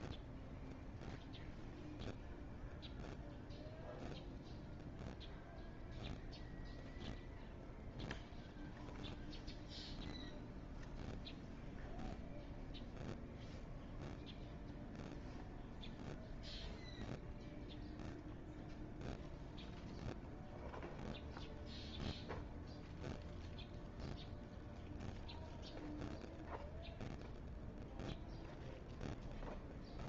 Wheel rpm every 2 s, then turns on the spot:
0, 0, 0, 0, 0, 0, 0, 0, 0, 0, 0, 0, 0, 0, 0.
none